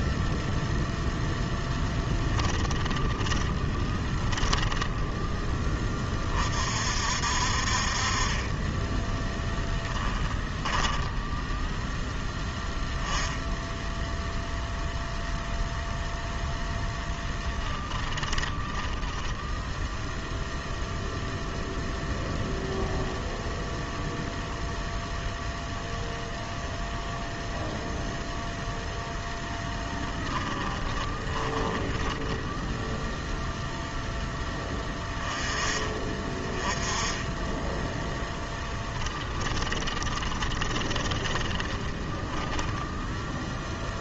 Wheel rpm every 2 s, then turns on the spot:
0, 20, 10, 50, 10, 10, 10, 0, 0, 20, 0, 0, 0, 0, 0, 10, 0, 20, 10, 20, 20, 10.
2-4 10-12 18-20 30-32 38-42